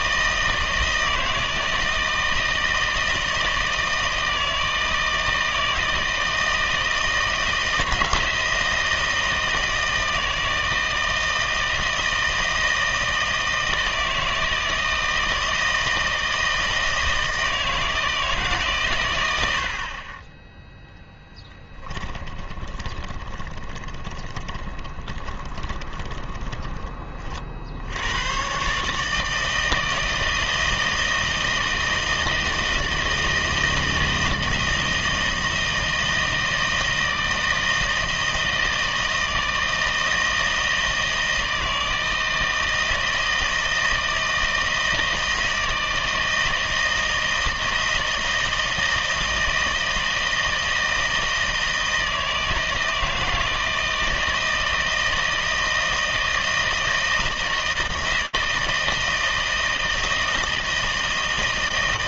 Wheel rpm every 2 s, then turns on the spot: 160, 160, 160, 160, 160, 160, 160, 160, 160, 140, 10, 20, 20, 20, 130, 160, 160, 160, 160, 160, 160, 160, 160, 160, 160, 160, 160, 160, 160, 160, 160.
22-28